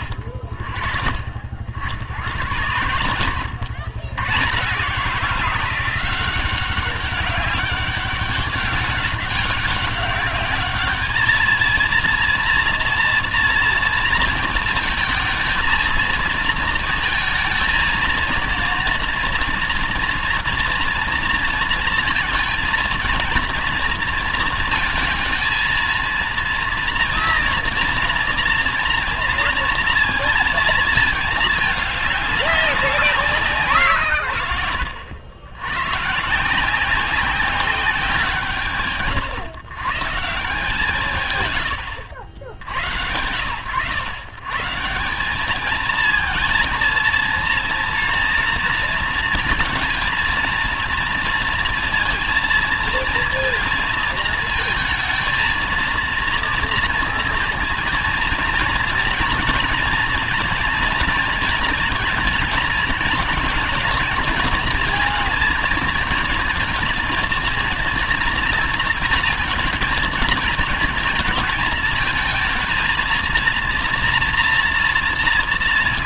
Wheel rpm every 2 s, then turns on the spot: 50, 80, 130, 190, 200, 200, 230, 230, 230, 230, 230, 230, 230, 230, 230, 230, 200, 90, 150, 160, 150, 90, 140, 230, 230, 230, 230, 220, 230, 240, 240, 220, 230, 230, 230, 220, 220, 230.
none